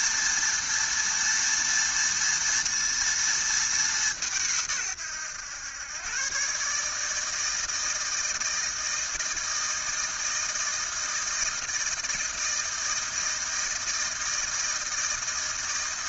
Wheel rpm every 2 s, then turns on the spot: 230, 230, 150, 140, 160, 160, 160, 160.
none